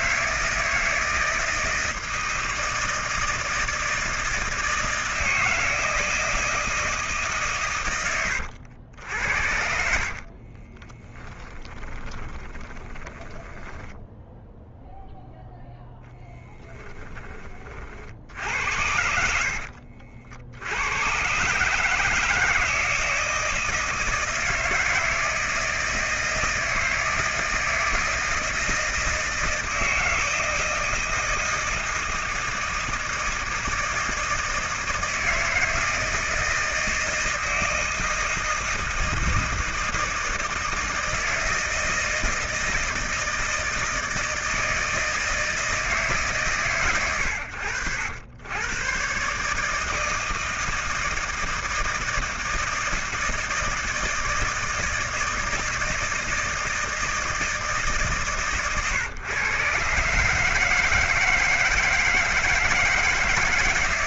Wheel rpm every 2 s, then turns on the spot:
160, 160, 160, 150, 80, 30, 10, 0, 10, 70, 100, 160, 160, 170, 170, 160, 160, 160, 160, 160, 160, 170, 160, 110, 130, 160, 160, 160, 160, 130, 160, 160.
10-14